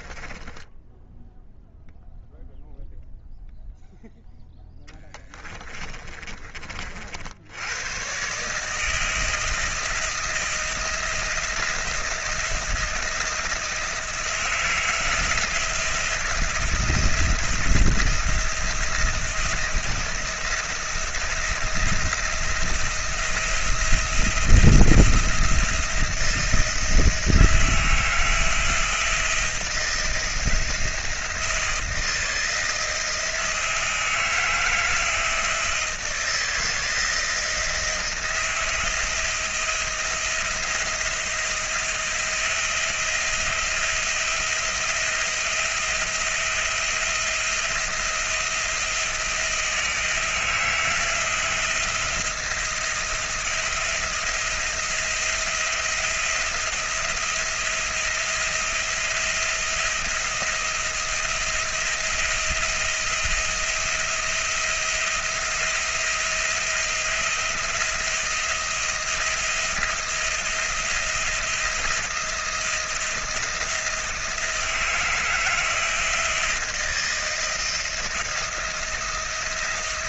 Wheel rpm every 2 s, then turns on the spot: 10, 0, 10, 50, 160, 160, 170, 160, 170, 170, 170, 170, 170, 160, 170, 170, 160, 160, 170, 170, 170, 170, 170, 170, 170, 170, 170, 170, 170, 170, 170, 170, 170, 170, 170, 170, 170, 160, 170, 170.
0-2 4-6